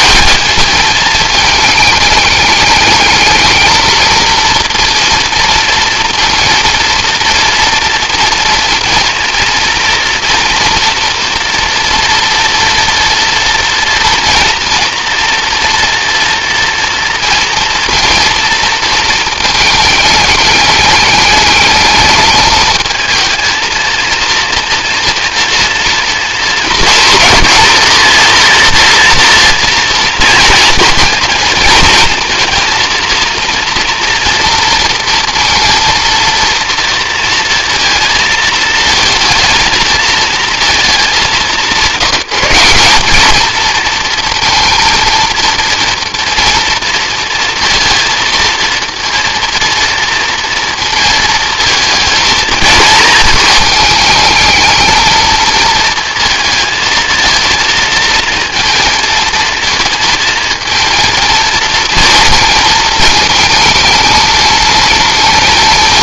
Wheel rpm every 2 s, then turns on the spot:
220, 220, 230, 230, 230, 240, 230, 230, 230, 230, 210, 220, 240, 230, 230, 230, 230, 230, 230, 230, 220, 200, 230, 230, 230, 230, 220, 220, 230, 230, 230, 220, 220.
none